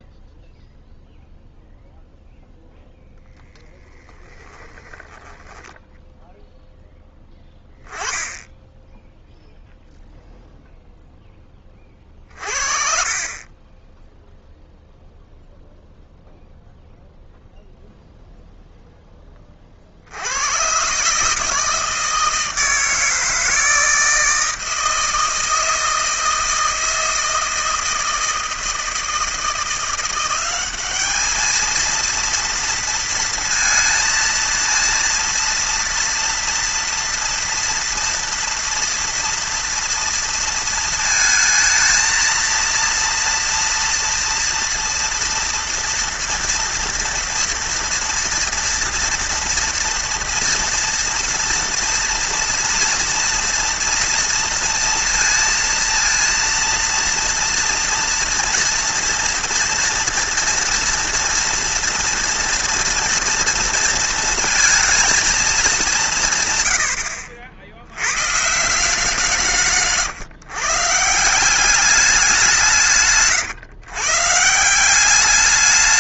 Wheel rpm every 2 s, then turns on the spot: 0, 0, 10, 0, 10, 0, 40, 0, 0, 0, 100, 160, 160, 160, 160, 190, 230, 230, 230, 230, 230, 230, 230, 230, 230, 230, 230, 230, 230, 230, 230, 230, 230, 120, 150, 150, 180, 160.
none